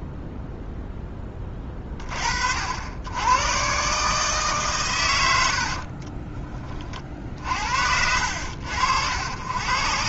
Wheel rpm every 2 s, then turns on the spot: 10, 70, 130, 30, 80.
none